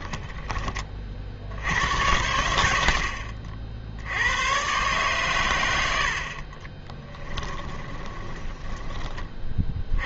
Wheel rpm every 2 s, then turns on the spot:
20, 80, 120, 30, 10.
6-10